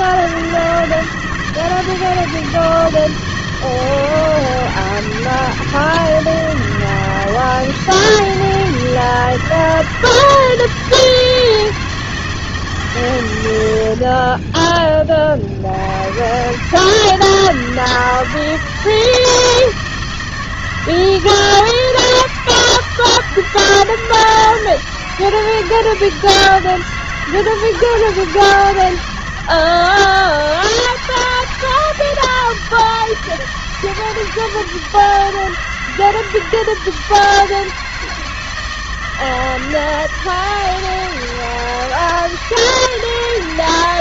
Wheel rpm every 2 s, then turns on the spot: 160, 160, 160, 160, 160, 160, 150, 20, 140, 160, 160, 160, 160, 160, 160, 160, 160, 160, 160, 160, 160, 160.
none